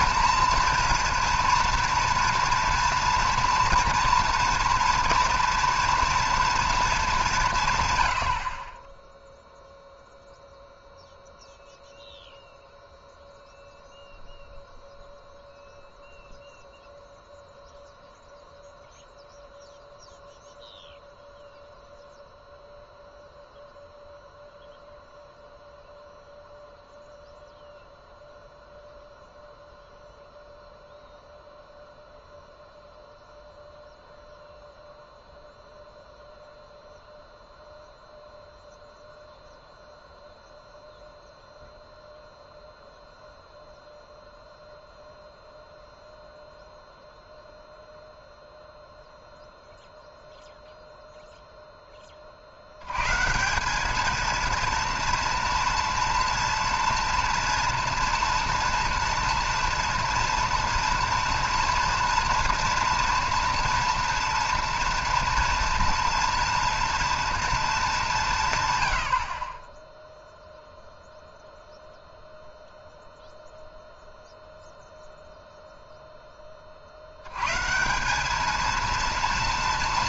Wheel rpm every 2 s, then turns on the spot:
240, 230, 230, 230, 40, 0, 0, 0, 0, 0, 0, 0, 0, 0, 0, 0, 0, 0, 0, 0, 0, 0, 0, 0, 0, 0, 80, 230, 230, 230, 230, 230, 230, 240, 120, 0, 0, 0, 30, 220.
none